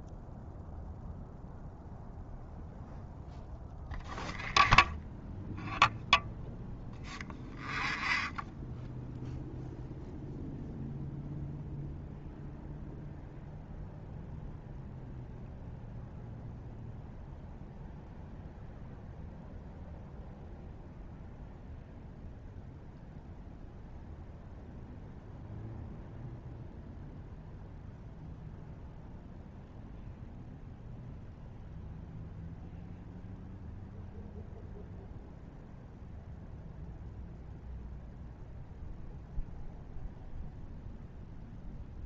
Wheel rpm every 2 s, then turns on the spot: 0, 0, 0, 0, 0, 0, 0, 0, 0, 0, 0, 0, 0, 0, 0, 0, 0, 0, 0, 0, 0.
none